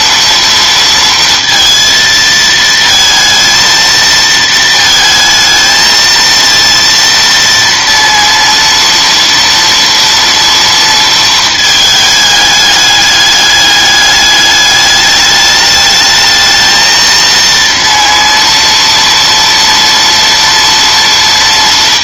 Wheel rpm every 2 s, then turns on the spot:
230, 230, 220, 230, 230, 230, 210, 210, 220, 230, 240.
none